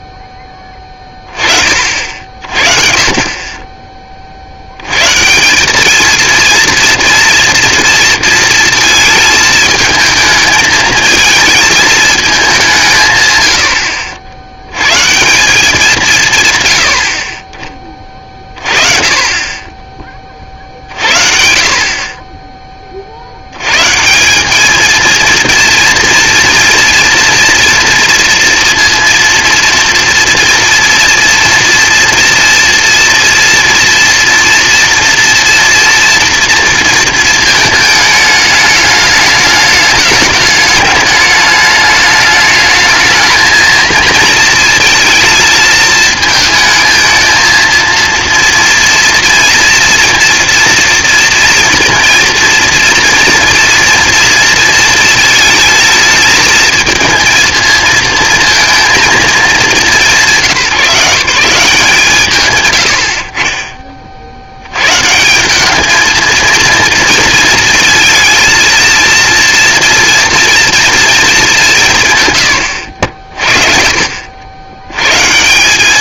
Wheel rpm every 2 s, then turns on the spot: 10, 40, 80, 230, 230, 220, 200, 90, 120, 40, 40, 20, 210, 230, 230, 230, 230, 230, 230, 210, 210, 210, 220, 220, 230, 230, 230, 230, 220, 230, 180, 110, 110, 230, 230, 230, 100, 90.
none